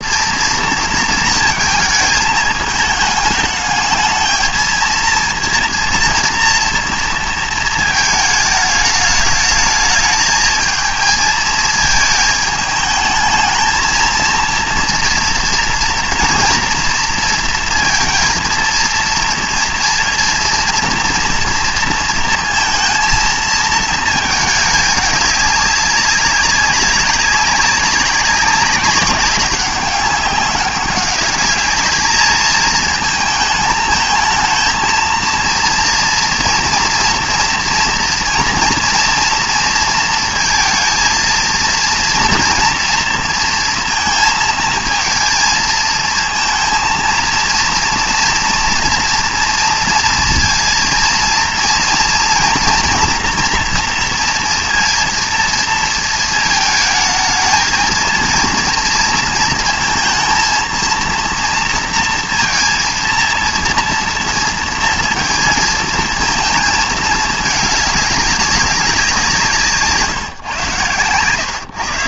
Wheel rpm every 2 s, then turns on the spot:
230, 210, 230, 230, 210, 220, 220, 230, 230, 230, 230, 230, 210, 190, 190, 200, 220, 230, 230, 240, 230, 230, 230, 230, 240, 230, 240, 230, 220, 230, 230, 230, 230, 220, 190, 120.
none